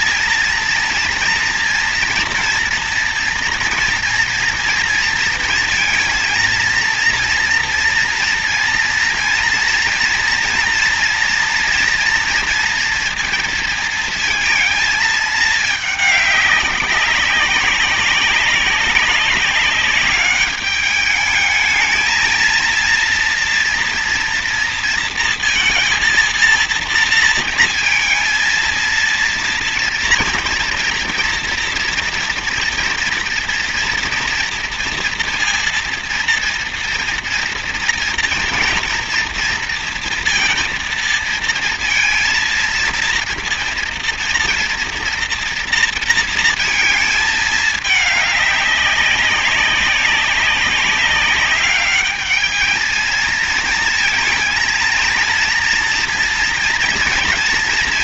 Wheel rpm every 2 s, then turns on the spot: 230, 230, 230, 230, 230, 240, 230, 220, 200, 190, 200, 230, 230, 230, 230, 230, 230, 230, 230, 230, 230, 230, 230, 230, 200, 200, 220, 230, 230.
none